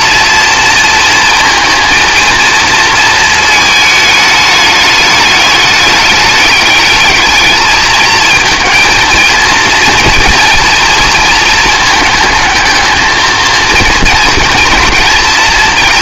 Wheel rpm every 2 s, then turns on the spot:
230, 230, 210, 210, 230, 230, 220, 230.
none